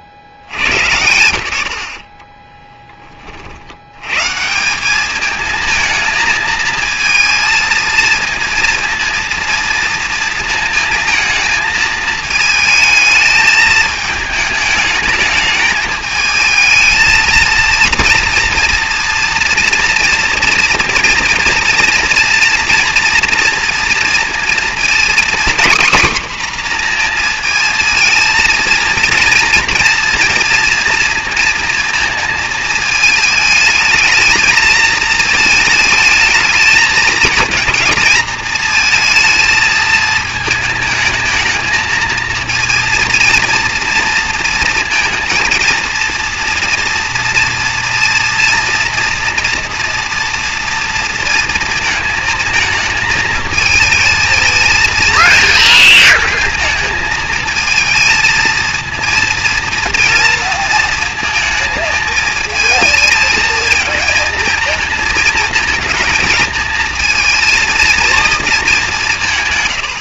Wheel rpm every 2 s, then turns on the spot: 70, 20, 180, 220, 230, 220, 220, 210, 220, 230, 230, 240, 240, 250, 230, 230, 220, 220, 220, 220, 220, 230, 230, 230, 230, 230, 220, 220, 220, 230, 230, 220, 220, 220, 200.
none